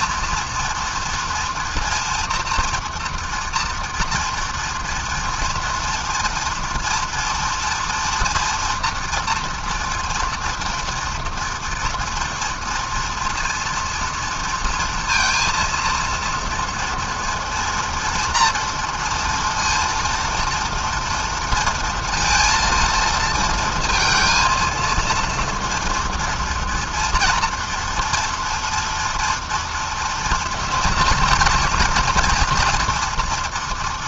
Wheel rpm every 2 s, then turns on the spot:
230, 240, 230, 240, 240, 230, 230, 230, 230, 230, 230, 230, 230, 230, 230, 230, 230.
none